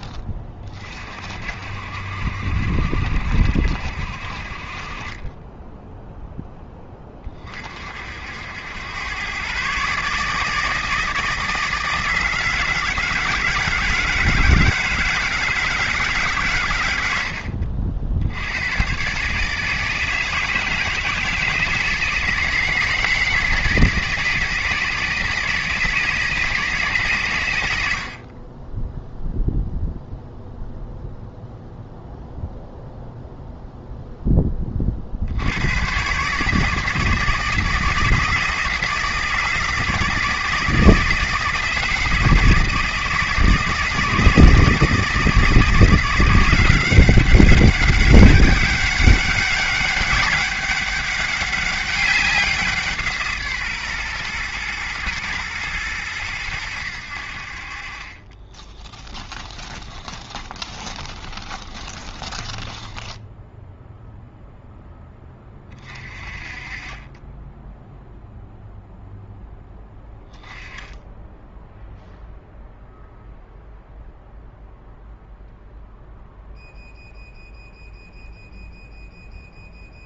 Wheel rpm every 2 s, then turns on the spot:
40, 60, 40, 20, 100, 160, 160, 160, 90, 130, 160, 160, 160, 140, 10, 0, 0, 50, 160, 160, 160, 160, 160, 190, 200, 200, 160, 120, 80, 30, 20, 10, 10, 30, 0, 10, 0, 0, 0, 0.
58-64